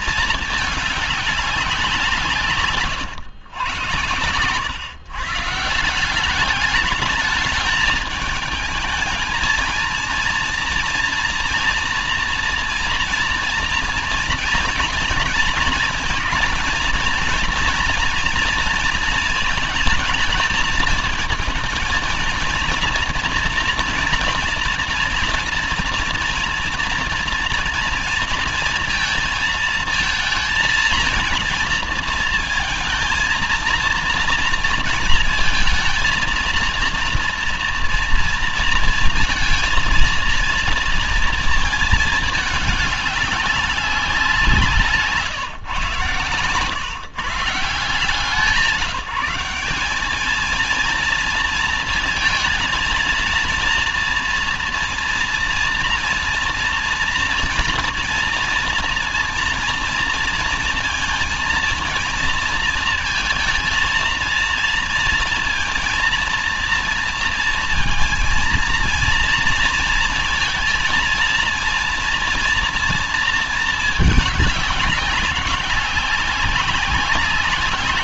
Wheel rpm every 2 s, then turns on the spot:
200, 120, 150, 210, 220, 230, 230, 230, 230, 220, 220, 230, 240, 230, 220, 230, 230, 230, 230, 230, 230, 200, 140, 150, 180, 230, 230, 230, 240, 230, 230, 220, 230, 230, 230, 230, 230, 190, 200.
none